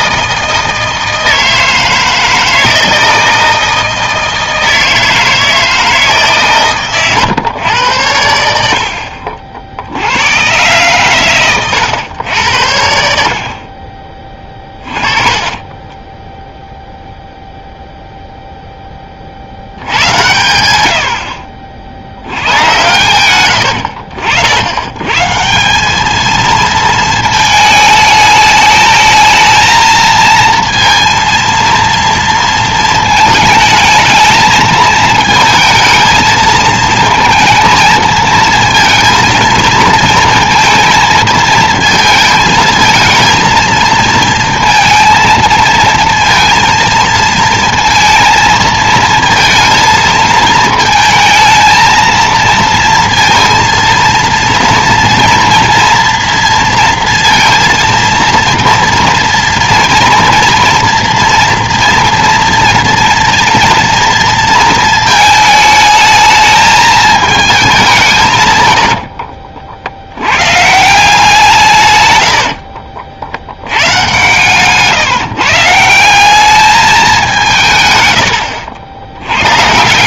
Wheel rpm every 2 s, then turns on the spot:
160, 160, 160, 130, 70, 120, 90, 30, 0, 0, 80, 110, 90, 230, 210, 230, 230, 220, 220, 230, 230, 220, 230, 230, 230, 220, 230, 230, 230, 230, 230, 230, 230, 220, 100, 140, 40, 140, 200, 80.
14-16 72-74